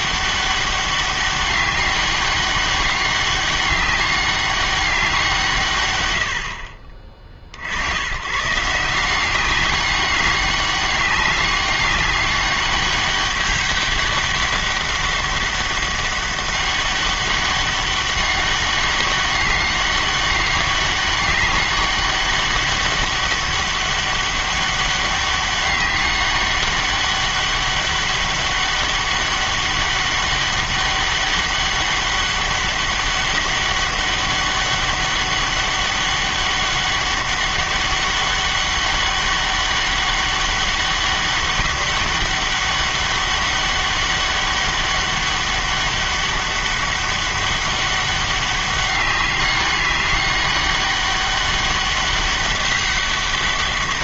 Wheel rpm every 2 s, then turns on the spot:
200, 200, 200, 60, 150, 200, 200, 200, 200, 200, 200, 200, 200, 200, 200, 200, 200, 200, 200, 200, 200, 200, 200, 200, 200, 200, 200.
none